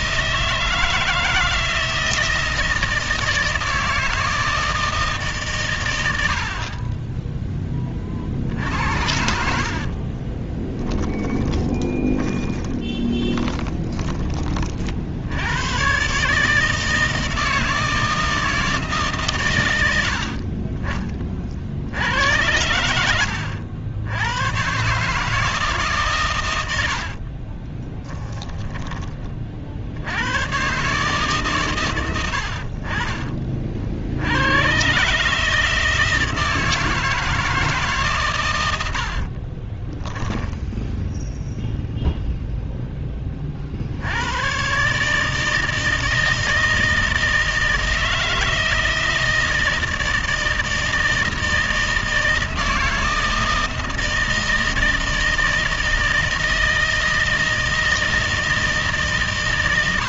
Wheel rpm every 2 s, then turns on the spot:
160, 160, 160, 60, 60, 20, 20, 30, 150, 160, 50, 80, 120, 100, 10, 110, 60, 110, 160, 120, 10, 0, 120, 160, 160, 160, 160, 160, 160, 160.
10-14 20-22 28-30 40-42